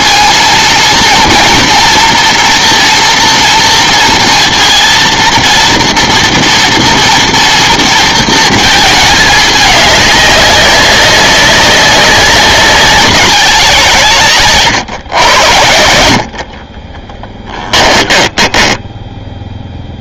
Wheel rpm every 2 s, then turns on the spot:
220, 230, 230, 230, 220, 200, 190, 140, 40, 20.
16-20